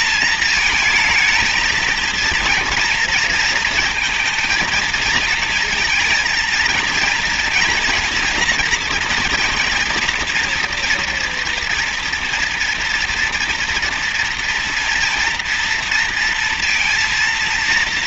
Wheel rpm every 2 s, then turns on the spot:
220, 230, 220, 230, 230, 230, 230, 230, 230.
none